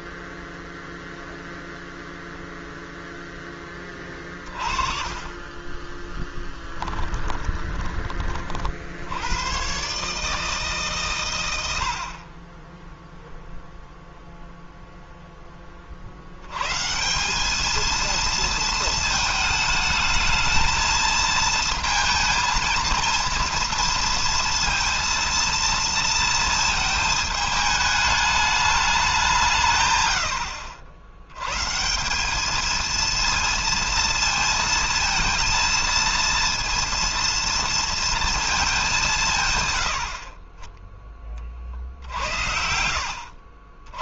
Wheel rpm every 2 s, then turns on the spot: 0, 0, 30, 20, 80, 140, 10, 0, 160, 220, 220, 230, 230, 220, 200, 90, 230, 230, 230, 180, 30, 60.
4-8